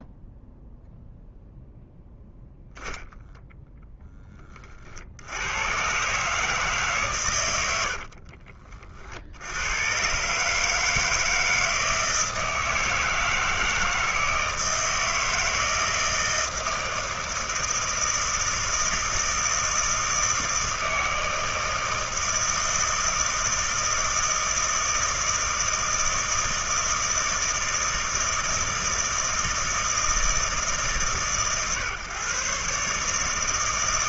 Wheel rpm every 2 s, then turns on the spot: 0, 0, 40, 150, 40, 150, 160, 160, 160, 160, 160, 160, 160, 160, 160, 150, 140.
none